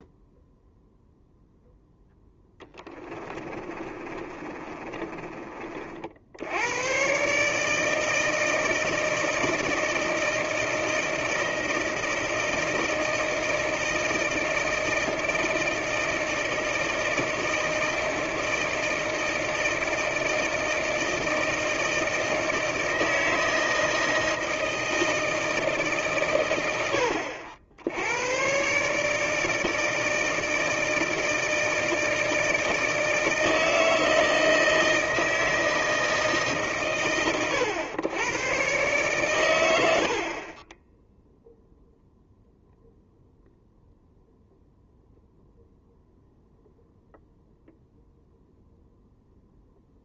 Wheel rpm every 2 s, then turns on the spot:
0, 10, 30, 100, 160, 160, 160, 160, 160, 160, 160, 160, 160, 100, 130, 160, 160, 160, 120, 120, 20, 0, 0, 0, 0.
2-6